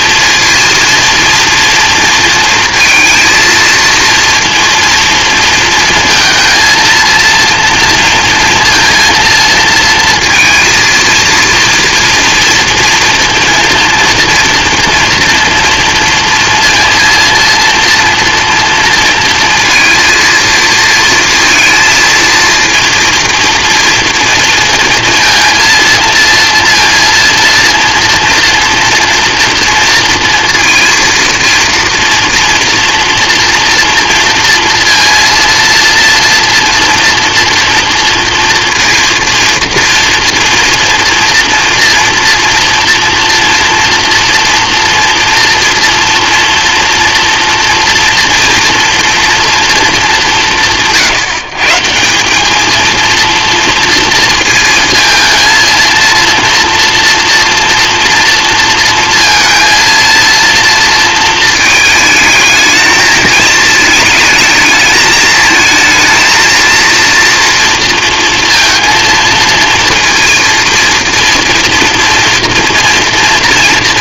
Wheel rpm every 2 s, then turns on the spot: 230, 230, 230, 230, 230, 230, 230, 230, 230, 230, 230, 230, 230, 230, 230, 230, 230, 230, 230, 230, 230, 230, 230, 240, 230, 160, 210, 230, 240, 230, 230, 220, 220, 230, 230, 230, 230.
none